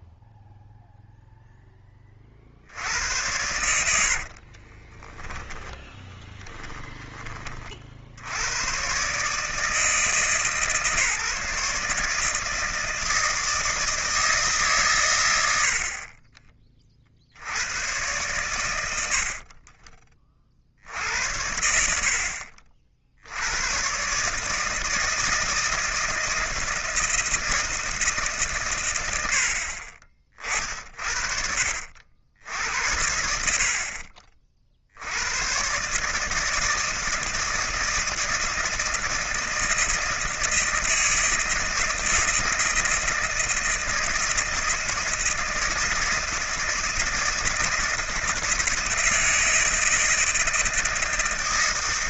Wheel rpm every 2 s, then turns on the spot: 0, 60, 30, 10, 110, 150, 160, 130, 20, 80, 60, 60, 150, 160, 130, 60, 70, 60, 160, 160, 160, 160, 160, 160, 160, 160.
4-8